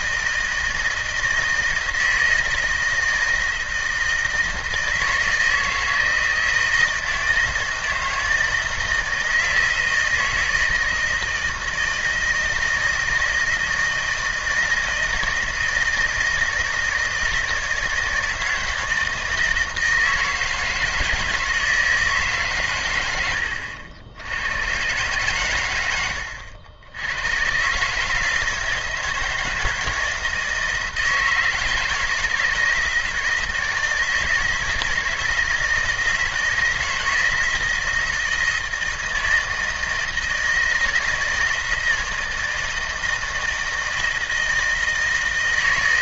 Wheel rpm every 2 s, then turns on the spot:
160, 160, 160, 160, 160, 160, 160, 160, 160, 160, 160, 120, 110, 80, 160, 160, 160, 160, 160, 160, 160, 160, 160.
none